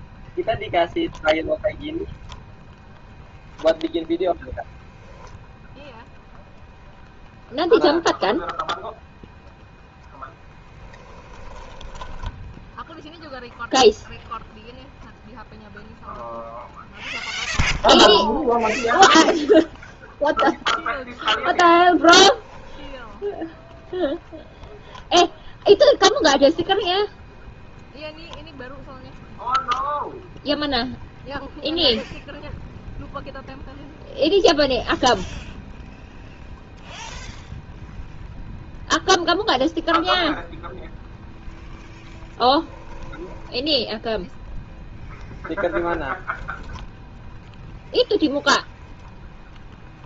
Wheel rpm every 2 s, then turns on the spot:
0, 0, 10, 0, 0, 10, 0, 0, 0, 0, 10, 10, 0, 0, 10, 0, 0, 0, 0, 0, 0, 10, 0, 10, 10.
10-12 20-24 42-44 48-50